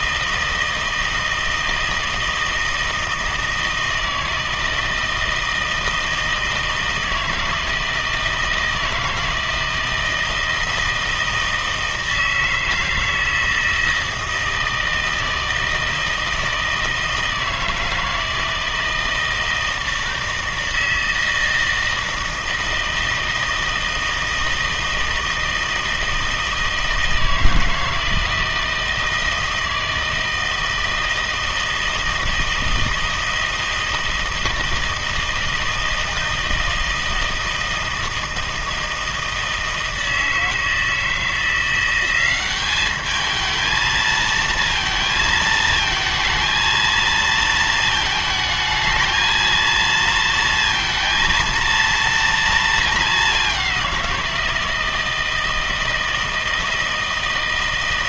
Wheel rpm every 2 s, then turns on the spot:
160, 160, 160, 160, 160, 160, 160, 160, 160, 160, 160, 160, 160, 160, 160, 160, 160, 160, 160, 160, 160, 200, 230, 230, 220, 230, 230, 170, 160.
none